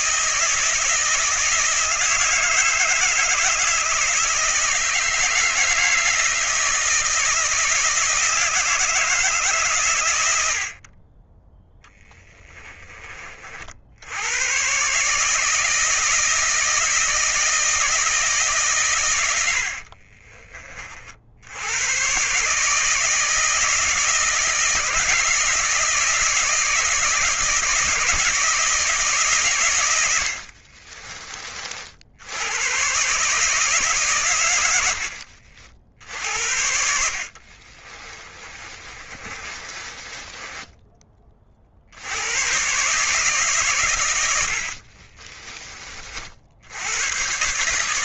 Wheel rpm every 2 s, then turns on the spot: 160, 160, 160, 160, 160, 50, 20, 140, 160, 120, 40, 160, 160, 170, 160, 40, 120, 90, 60, 30, 20, 140, 60, 90.
30-32 38-40 44-46